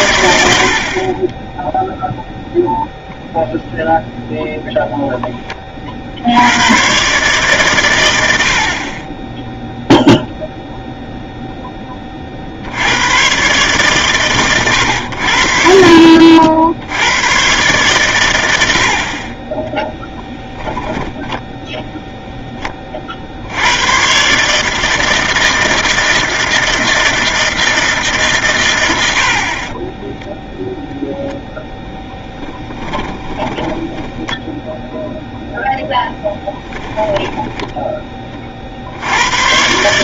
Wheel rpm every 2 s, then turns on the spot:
90, 0, 10, 130, 30, 0, 90, 90, 70, 70, 10, 20, 160, 160, 100, 10, 10, 10, 10, 50.
20-22 32-34 36-38